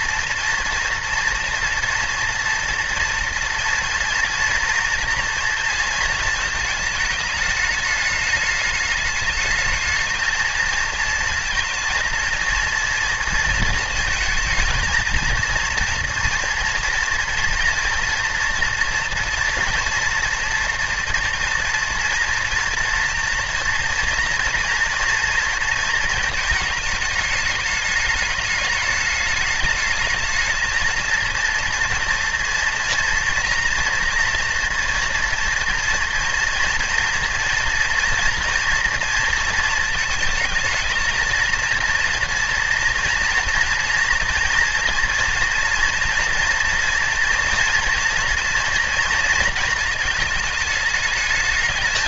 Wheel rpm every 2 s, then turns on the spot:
230, 240, 230, 220, 210, 220, 230, 230, 230, 230, 230, 230, 230, 210, 210, 220, 230, 230, 240, 230, 220, 240, 230, 230, 230, 220.
none